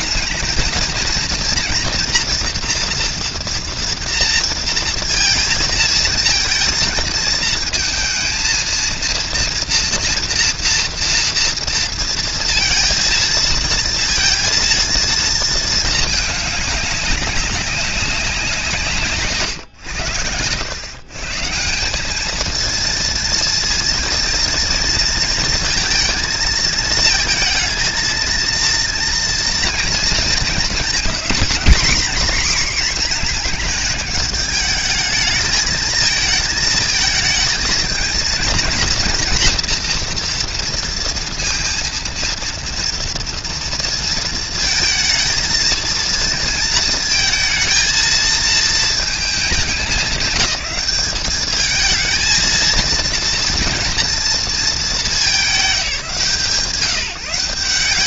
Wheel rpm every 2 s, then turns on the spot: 220, 240, 230, 230, 230, 230, 230, 230, 210, 170, 90, 220, 230, 230, 230, 240, 250, 220, 220, 240, 240, 230, 230, 230, 230, 210, 230, 230, 160.
none